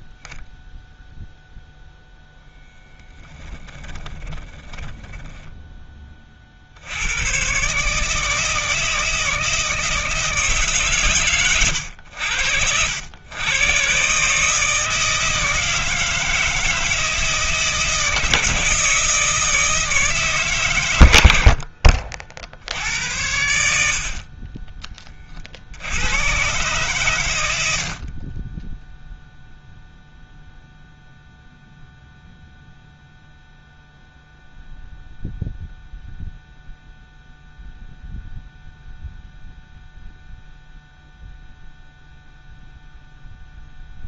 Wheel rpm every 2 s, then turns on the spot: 0, 10, 20, 60, 160, 150, 70, 160, 160, 160, 120, 80, 20, 130, 10, 0, 0, 0, 0, 0, 0, 0.
4-6